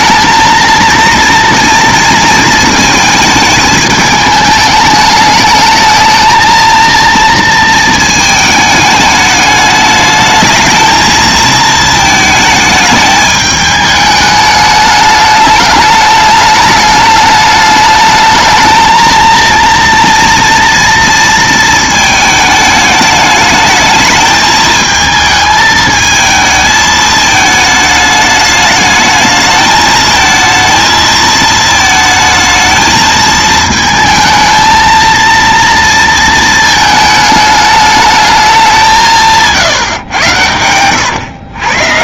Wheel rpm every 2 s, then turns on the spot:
230, 230, 210, 230, 220, 220, 220, 210, 210, 220, 230, 210, 220, 220, 210, 230, 220, 230, 220, 190, 100.
none